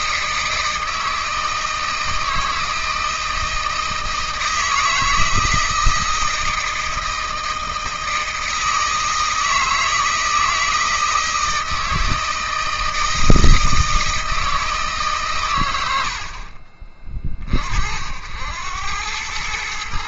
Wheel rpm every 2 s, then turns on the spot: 160, 160, 160, 160, 160, 160, 160, 150, 40, 100.
none